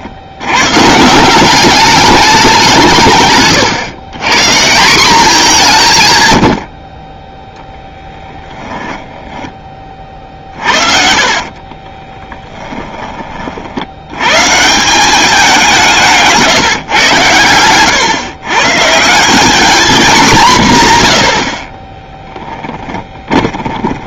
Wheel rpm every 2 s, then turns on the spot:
100, 190, 160, 90, 20, 40, 10, 150, 160, 130, 180, 10.
8-14 22-24